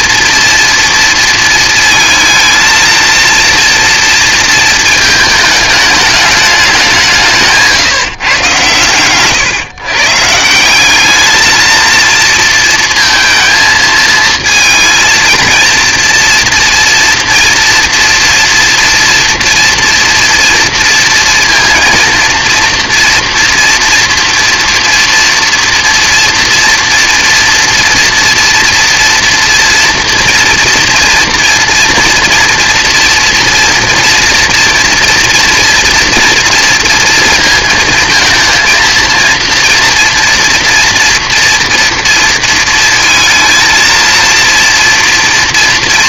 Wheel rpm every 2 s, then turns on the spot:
230, 230, 230, 190, 120, 180, 230, 230, 240, 230, 230, 230, 230, 230, 230, 230, 240, 240, 230, 230, 230, 230, 230.
none